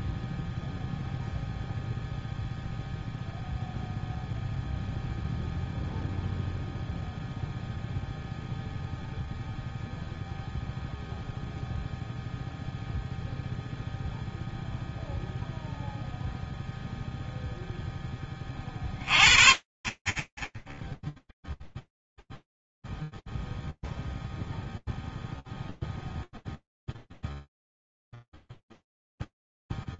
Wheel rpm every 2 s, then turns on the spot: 0, 0, 0, 0, 0, 0, 0, 0, 0, 20, 10, 0, 0, 0, 0.
none